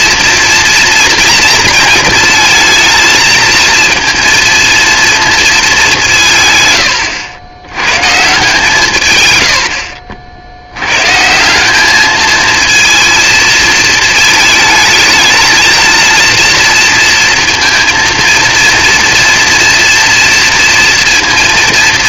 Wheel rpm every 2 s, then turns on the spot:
230, 220, 230, 130, 160, 80, 230, 220, 230, 230, 230.
none